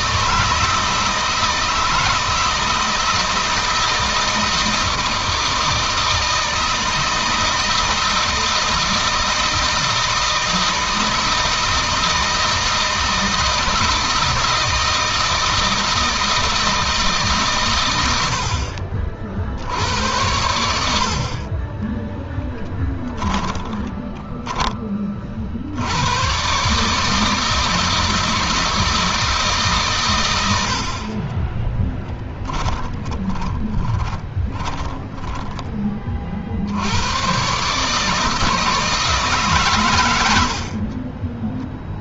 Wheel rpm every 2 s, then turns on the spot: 160, 160, 160, 160, 160, 160, 160, 160, 160, 70, 70, 10, 10, 130, 160, 80, 10, 30, 60, 160, 70.
22-24 32-36